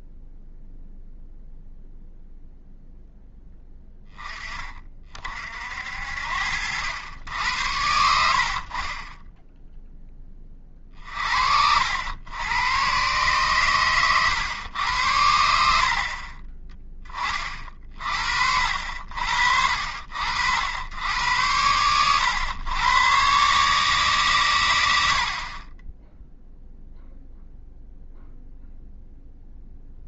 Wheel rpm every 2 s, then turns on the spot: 0, 0, 30, 80, 40, 30, 120, 100, 20, 60, 80, 110, 100, 0, 0.
none